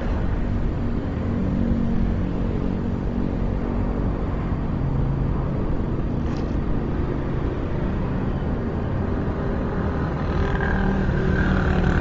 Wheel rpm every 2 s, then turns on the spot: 0, 0, 0, 0, 0, 50.
none